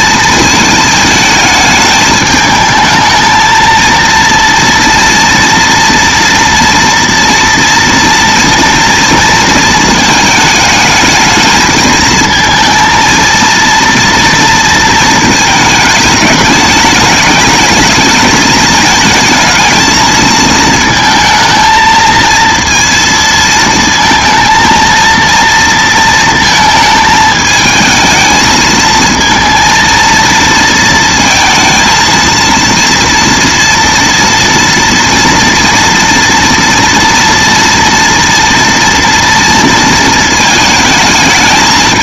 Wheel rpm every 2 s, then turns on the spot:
220, 220, 230, 230, 230, 220, 230, 230, 210, 220, 220, 230, 230, 230, 220, 230, 230, 230, 230, 230, 220.
none